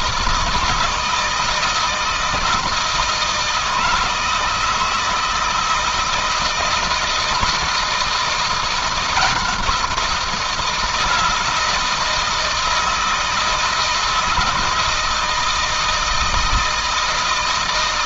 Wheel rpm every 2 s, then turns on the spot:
160, 160, 160, 160, 170, 170, 170, 160, 160.
none